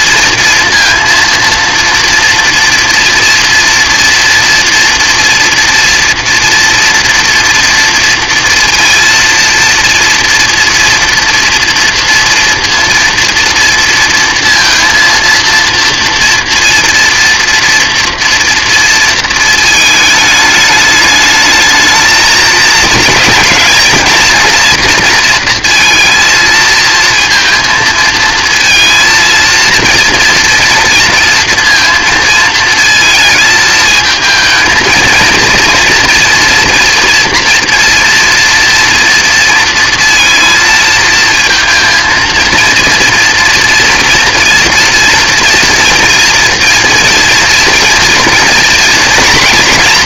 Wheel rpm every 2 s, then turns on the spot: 230, 230, 230, 230, 230, 230, 230, 230, 230, 230, 210, 230, 230, 220, 230, 240, 230, 230, 240, 230, 230, 230, 230, 230, 240.
none